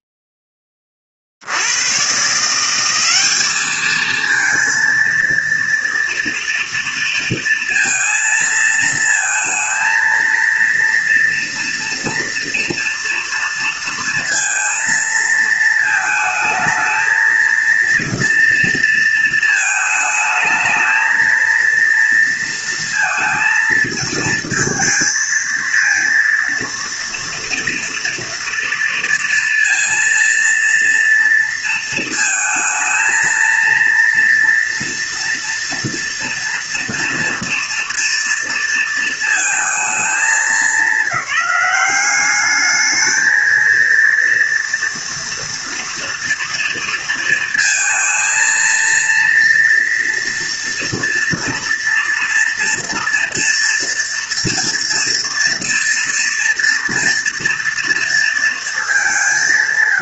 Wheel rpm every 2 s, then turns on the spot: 20, 190, 230, 230, 220, 230, 230, 230, 220, 230, 220, 230, 230, 230, 230, 230, 230, 240, 230, 230, 190, 210, 230, 230, 230, 230, 230, 230, 230, 200.
none